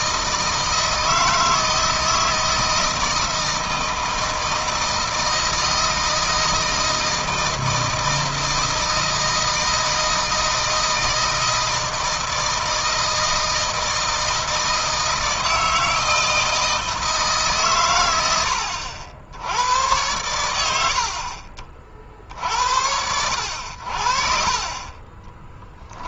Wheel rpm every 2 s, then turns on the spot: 160, 160, 160, 160, 160, 160, 160, 160, 160, 80, 80, 70, 30.
24-26